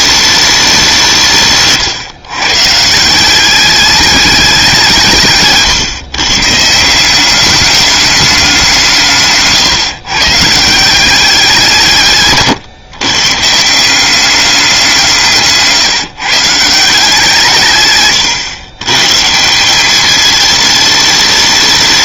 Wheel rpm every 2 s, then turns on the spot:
200, 130, 190, 150, 180, 170, 130, 190, 160, 120, 220.
none